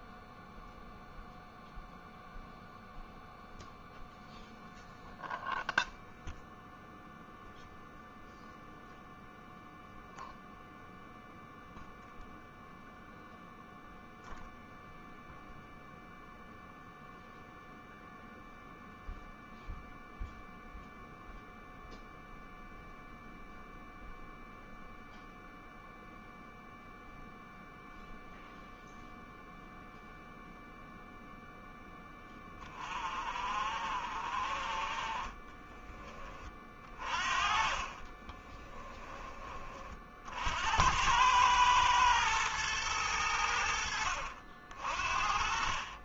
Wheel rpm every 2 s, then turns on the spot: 0, 0, 0, 0, 0, 0, 0, 0, 0, 0, 0, 0, 0, 0, 0, 0, 30, 30, 40, 20, 90, 110, 50.
none